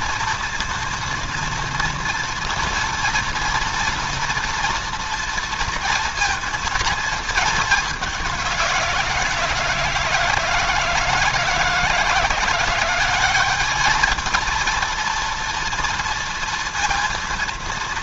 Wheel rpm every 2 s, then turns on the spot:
230, 240, 240, 230, 170, 160, 180, 230, 230.
none